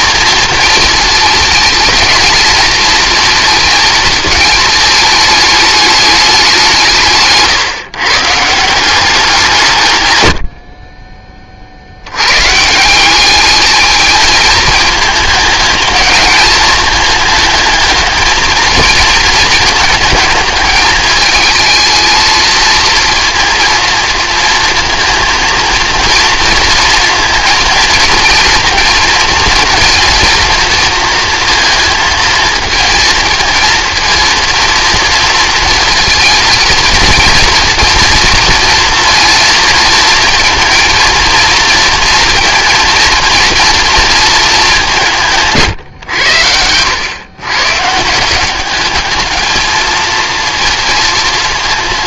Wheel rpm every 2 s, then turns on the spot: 220, 230, 210, 160, 170, 30, 170, 220, 220, 220, 220, 230, 230, 230, 230, 230, 220, 230, 230, 230, 230, 230, 190, 110, 210, 230.
none